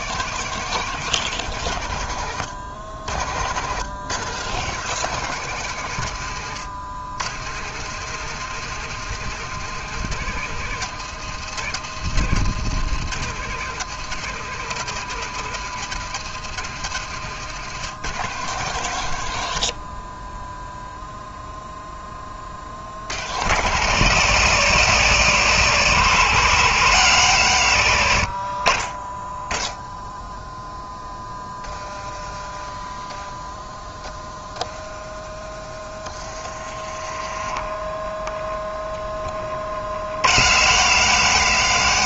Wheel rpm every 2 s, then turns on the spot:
160, 90, 140, 100, 150, 150, 140, 140, 140, 130, 0, 40, 130, 130, 40, 10, 10, 10, 30, 10, 100.
36-38